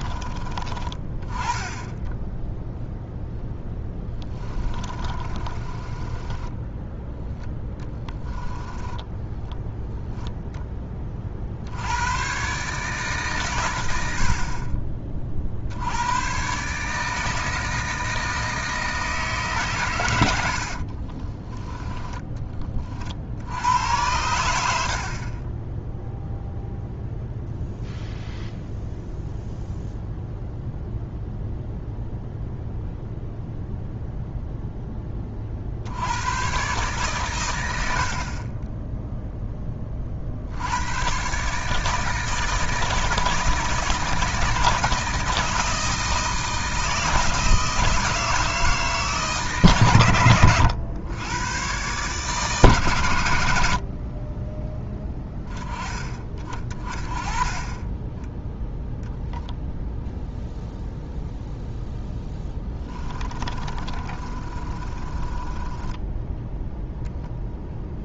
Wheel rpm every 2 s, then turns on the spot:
20, 0, 30, 10, 10, 20, 150, 40, 150, 160, 50, 40, 60, 0, 0, 0, 0, 10, 120, 10, 110, 160, 160, 160, 160, 100, 130, 10, 30, 0, 0, 20, 30, 0.
4-10 20-22 62-66